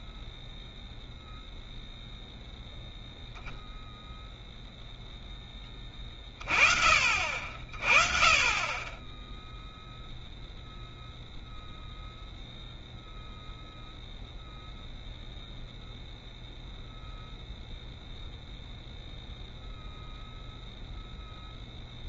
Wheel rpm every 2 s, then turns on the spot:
0, 0, 0, 40, 20, 0, 0, 0, 0, 0, 0.
none